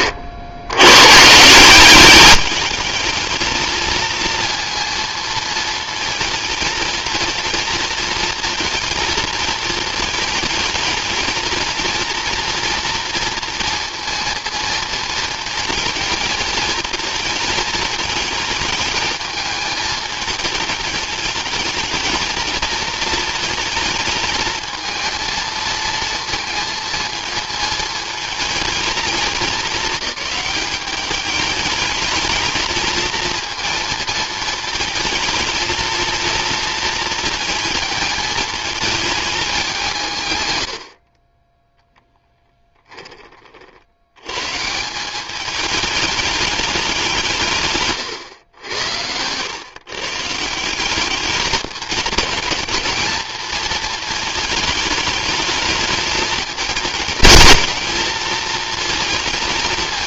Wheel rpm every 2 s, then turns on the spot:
80, 210, 230, 230, 220, 220, 230, 230, 220, 220, 220, 220, 220, 230, 220, 200, 220, 230, 230, 220, 70, 10, 170, 190, 90, 190, 220, 210, 220, 230.
none